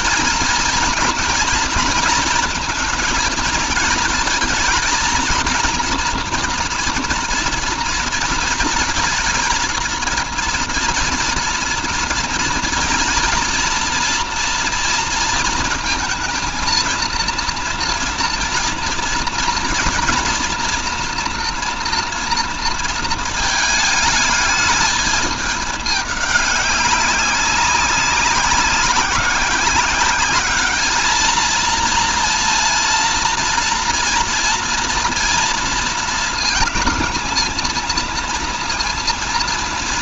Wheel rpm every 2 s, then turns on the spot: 230, 220, 230, 240, 220, 230, 230, 230, 230, 230, 230, 230, 210, 200, 190, 210, 230, 230, 230, 230.
none